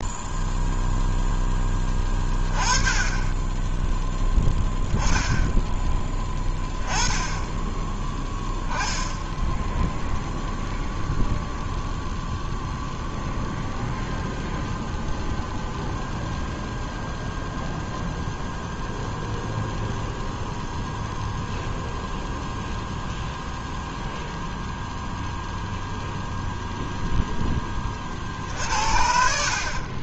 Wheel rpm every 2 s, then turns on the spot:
0, 20, 10, 10, 10, 0, 0, 0, 0, 0, 0, 0, 0, 10, 50.
none